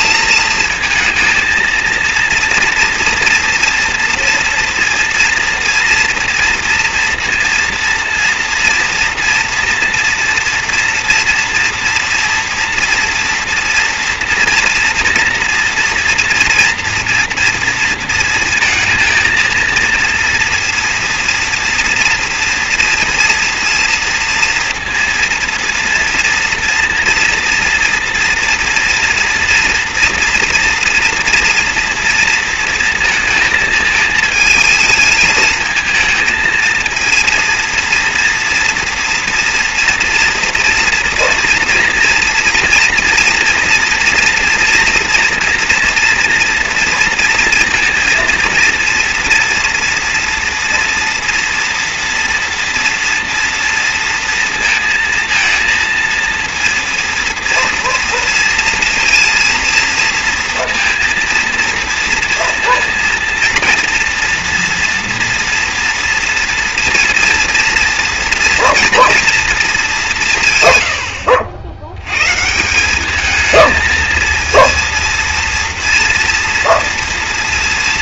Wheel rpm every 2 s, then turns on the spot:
230, 240, 240, 230, 230, 230, 230, 230, 230, 230, 230, 230, 230, 230, 230, 230, 230, 220, 230, 230, 240, 240, 230, 230, 230, 230, 230, 230, 230, 230, 230, 230, 230, 230, 240, 90, 210, 230, 230.
none